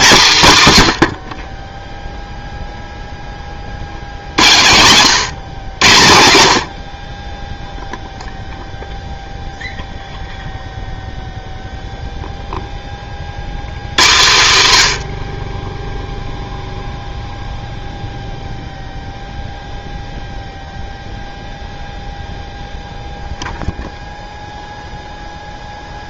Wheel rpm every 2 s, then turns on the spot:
160, 0, 100, 80, 0, 0, 10, 120, 0, 0, 0, 0, 0.
none